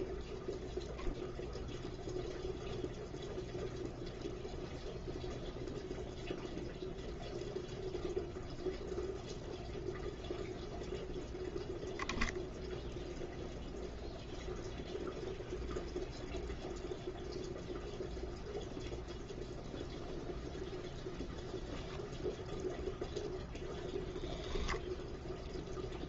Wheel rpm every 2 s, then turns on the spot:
0, 0, 0, 0, 0, 0, 0, 0, 0, 0, 0, 0, 0.
none